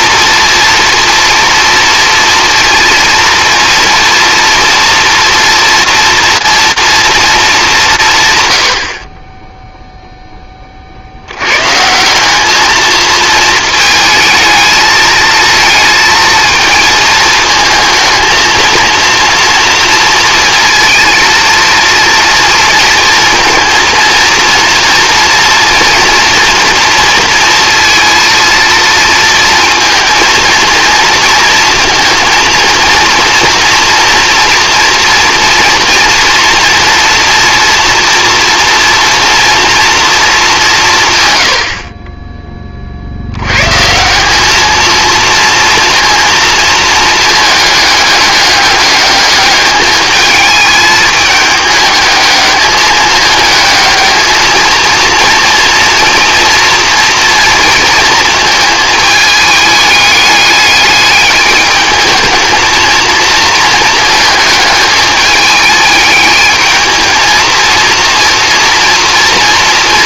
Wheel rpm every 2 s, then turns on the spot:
240, 230, 230, 230, 90, 30, 220, 220, 220, 220, 230, 230, 230, 230, 230, 230, 230, 230, 230, 230, 180, 20, 220, 230, 210, 220, 210, 220, 230, 220, 210, 220, 210, 220, 240.
none